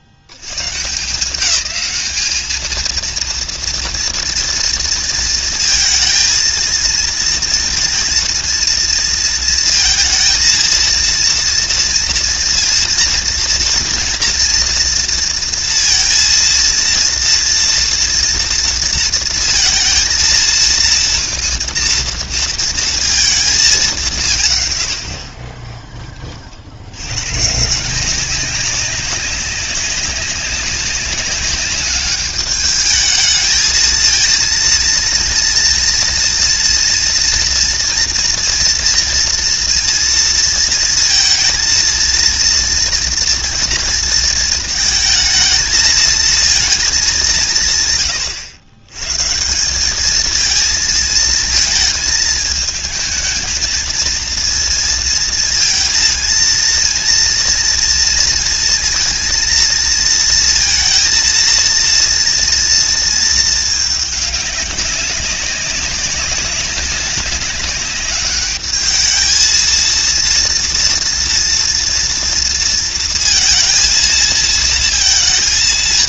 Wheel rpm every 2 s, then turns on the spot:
100, 220, 230, 230, 230, 230, 230, 230, 230, 230, 220, 230, 140, 50, 200, 190, 210, 230, 240, 230, 230, 230, 220, 220, 110, 220, 220, 230, 230, 230, 230, 230, 200, 200, 210, 230, 230, 220.
none